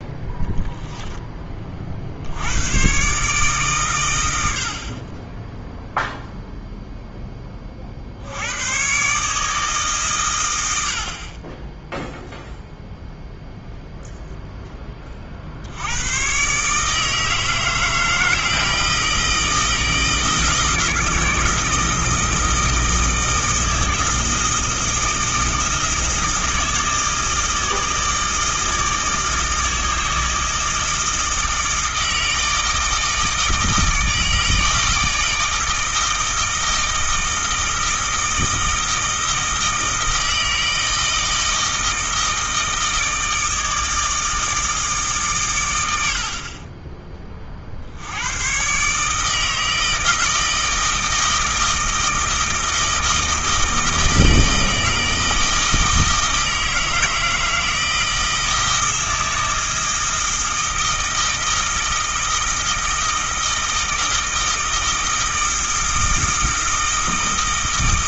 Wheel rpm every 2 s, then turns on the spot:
10, 130, 40, 0, 120, 60, 0, 20, 150, 160, 160, 160, 160, 160, 160, 160, 160, 160, 160, 160, 160, 160, 150, 30, 150, 160, 160, 160, 160, 160, 160, 160, 160, 160.
0-2